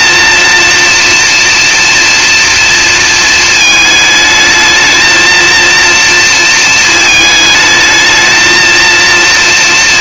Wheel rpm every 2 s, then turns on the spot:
230, 230, 220, 220, 230.
none